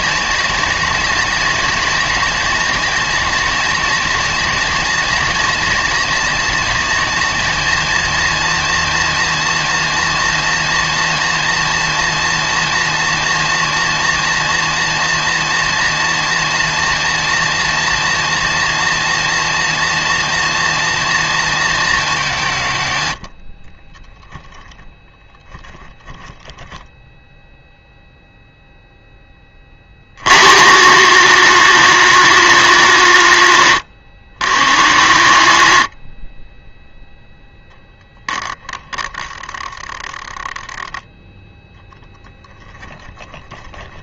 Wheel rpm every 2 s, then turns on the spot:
240, 240, 230, 230, 230, 230, 230, 230, 230, 230, 230, 150, 0, 10, 0, 200, 210, 150, 20, 10, 10, 20.
38-40 42-44